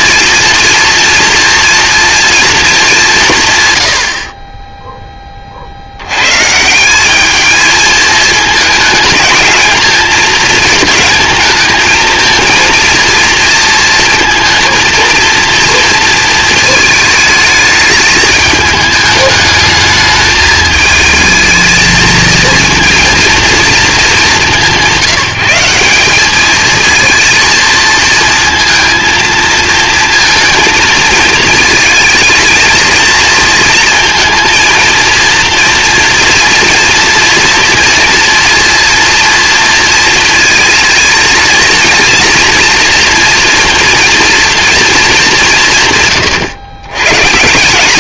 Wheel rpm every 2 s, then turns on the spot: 230, 210, 10, 150, 220, 220, 230, 230, 220, 210, 220, 230, 200, 220, 230, 230, 220, 230, 230, 240, 220, 230, 230, 130.
none